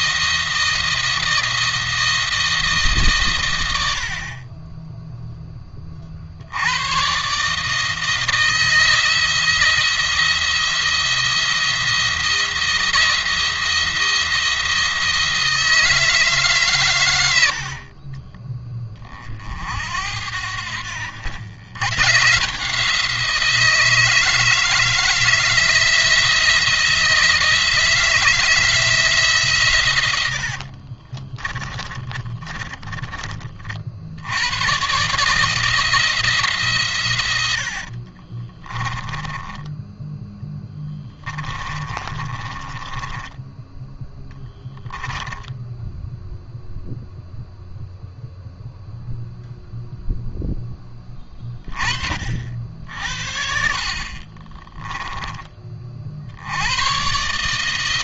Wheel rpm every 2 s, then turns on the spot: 170, 150, 20, 90, 170, 170, 170, 160, 120, 20, 80, 160, 160, 170, 160, 50, 30, 120, 140, 20, 10, 20, 10, 0, 0, 10, 60, 20, 100.
30-34 38-44 54-56